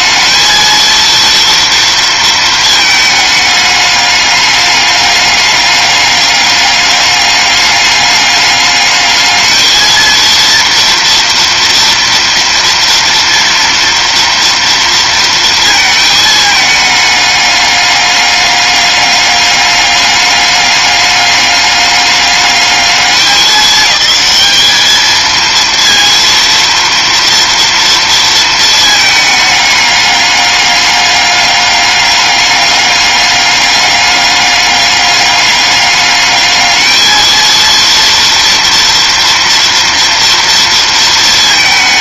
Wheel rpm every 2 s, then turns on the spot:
230, 220, 200, 200, 210, 230, 230, 230, 210, 200, 200, 210, 220, 230, 220, 200, 200, 200, 220, 230, 230.
none